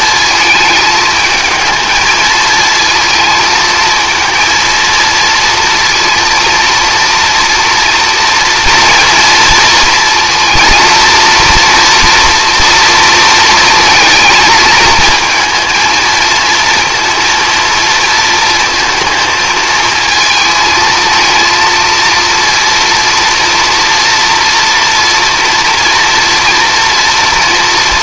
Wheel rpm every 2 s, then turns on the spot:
220, 220, 230, 230, 230, 230, 230, 220, 230, 230, 220, 240, 230, 230.
none